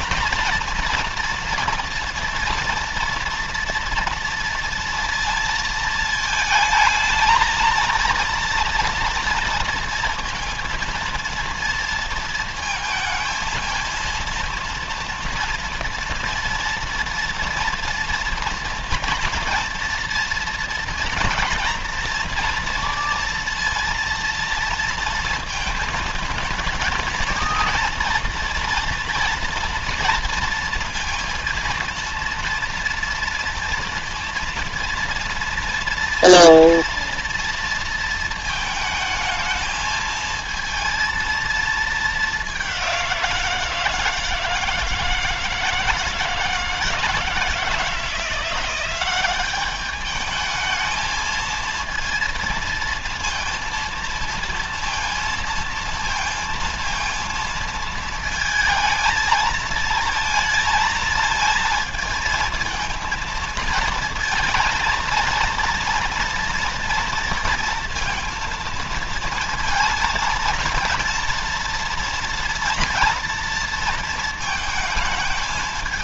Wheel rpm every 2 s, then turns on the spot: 240, 230, 230, 220, 230, 230, 230, 230, 230, 230, 230, 230, 230, 220, 230, 230, 230, 230, 240, 220, 230, 200, 160, 160, 180, 210, 230, 230, 230, 220, 230, 220, 230, 230, 230, 230, 230, 220.
none